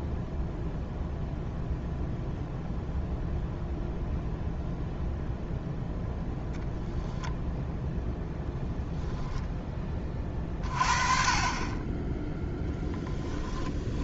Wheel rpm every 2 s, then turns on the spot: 0, 0, 0, 10, 10, 40, 10.
12-14